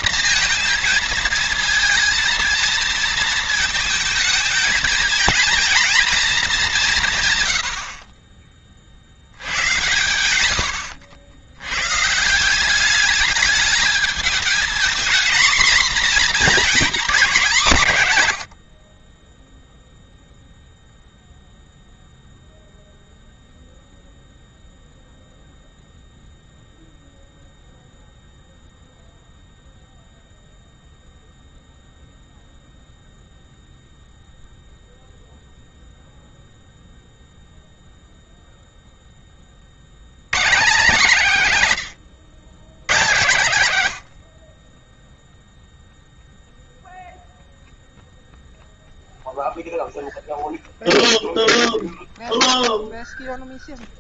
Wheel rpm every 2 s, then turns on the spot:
230, 220, 230, 160, 50, 70, 190, 230, 230, 30, 0, 0, 0, 0, 0, 0, 0, 0, 0, 10, 190, 130, 20, 0, 0, 0, 0.
18-20 42-46